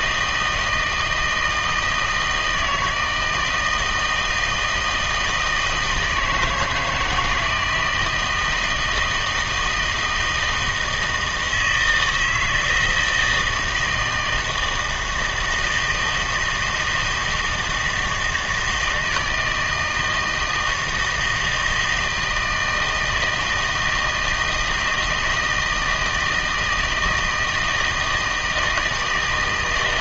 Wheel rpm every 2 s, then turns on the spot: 160, 160, 160, 160, 170, 160, 160, 160, 160, 160, 160, 160, 160, 160, 160.
none